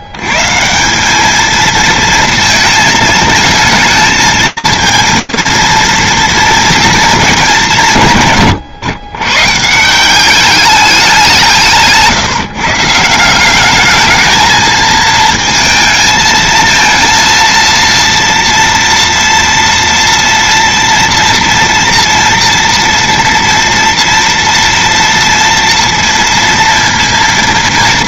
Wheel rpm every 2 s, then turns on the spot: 140, 220, 220, 230, 130, 200, 140, 220, 230, 230, 230, 230, 230, 230.
none